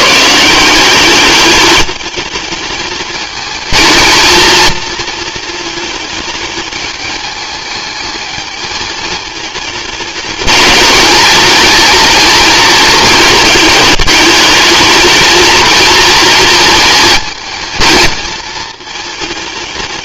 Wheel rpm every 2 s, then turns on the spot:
190, 220, 220, 210, 220, 220, 220, 220, 230, 220.
none